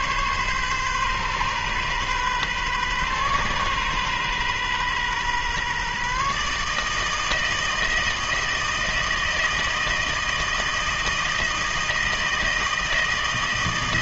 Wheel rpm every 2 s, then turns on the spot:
130, 130, 130, 150, 160, 160, 160.
none